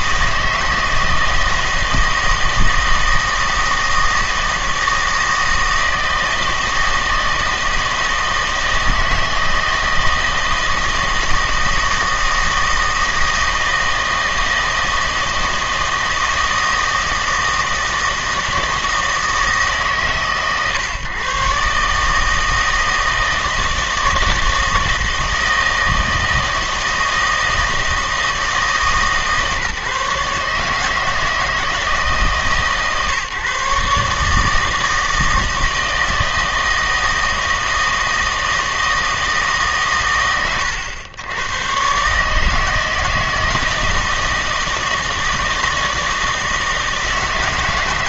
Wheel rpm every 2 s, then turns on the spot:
160, 160, 160, 160, 160, 160, 160, 160, 160, 160, 140, 160, 160, 160, 160, 150, 140, 160, 160, 160, 110, 160, 160, 160.
none